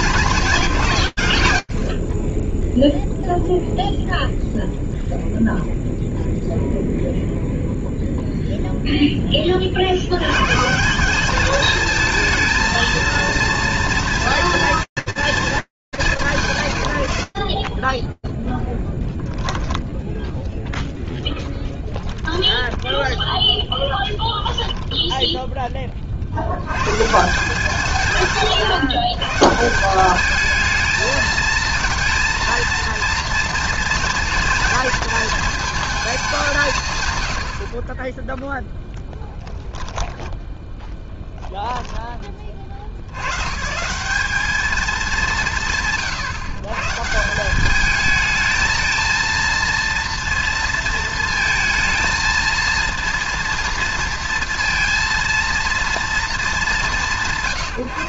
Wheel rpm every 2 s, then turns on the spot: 100, 0, 0, 0, 30, 210, 230, 140, 0, 10, 10, 10, 40, 150, 190, 230, 230, 220, 20, 20, 10, 170, 150, 210, 230, 230, 230, 220, 150.
38-40